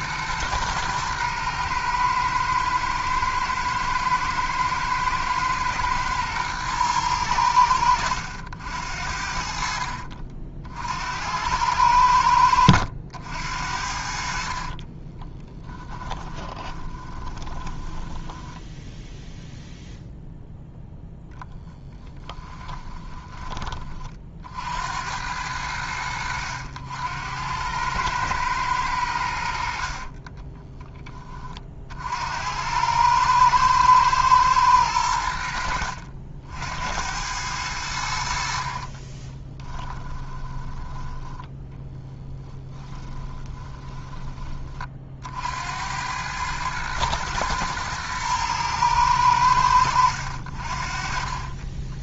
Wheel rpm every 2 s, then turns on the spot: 110, 110, 110, 110, 70, 60, 80, 30, 20, 10, 0, 20, 40, 80, 100, 10, 90, 100, 80, 40, 10, 20, 30, 110, 110, 40.
14-18 22-24 38-40 42-44 50-52